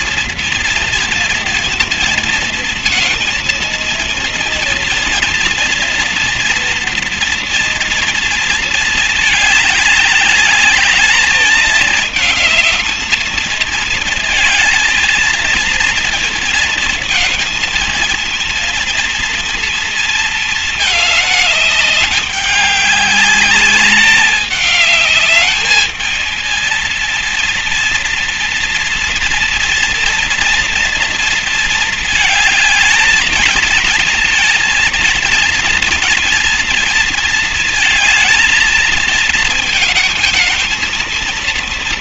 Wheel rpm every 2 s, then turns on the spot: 230, 230, 230, 230, 210, 210, 220, 220, 230, 230, 210, 200, 210, 230, 230, 230, 220, 230, 230, 220, 230.
none